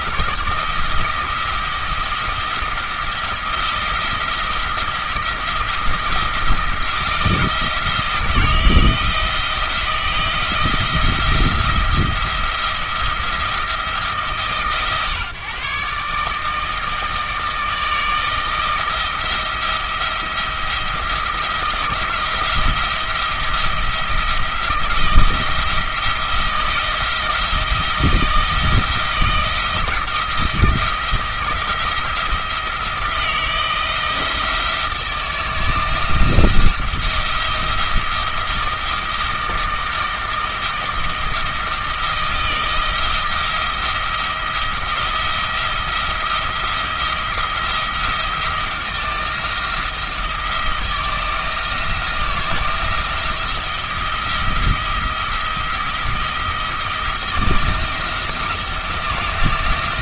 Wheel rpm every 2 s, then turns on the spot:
170, 170, 170, 170, 160, 170, 170, 140, 160, 160, 170, 170, 170, 170, 160, 170, 170, 170, 170, 170, 160, 160, 170, 170, 170, 170, 170, 170, 170, 170.
none